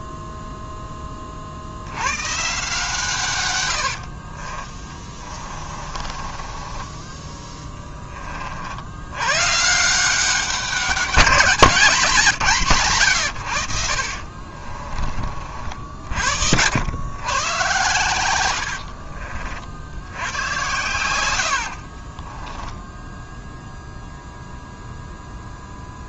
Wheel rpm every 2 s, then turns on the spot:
10, 140, 40, 20, 80, 200, 120, 30, 100, 60, 90, 10, 0.
4-8 14-16 18-20